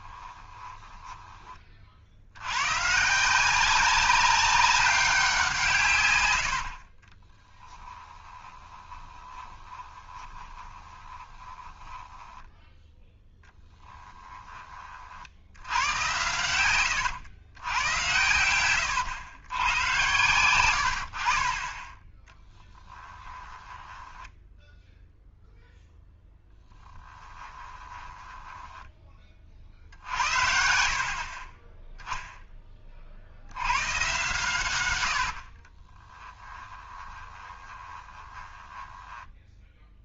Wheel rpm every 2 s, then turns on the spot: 20, 120, 190, 70, 20, 20, 10, 30, 110, 110, 90, 10, 0, 10, 10, 60, 20, 110, 10, 20.
0-2 6-12 18-20 22-24 28-32 34-40